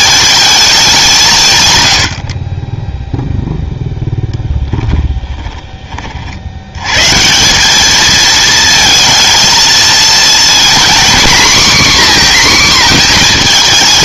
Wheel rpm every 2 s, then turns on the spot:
220, 30, 10, 80, 220, 240, 250.
4-6